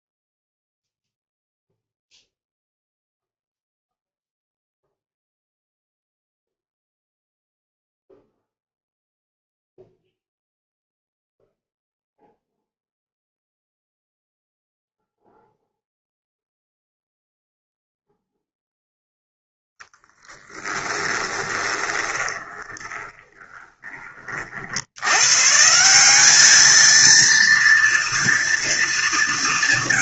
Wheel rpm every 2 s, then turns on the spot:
0, 0, 0, 0, 0, 0, 0, 0, 0, 0, 10, 20, 40, 210, 230.
22-24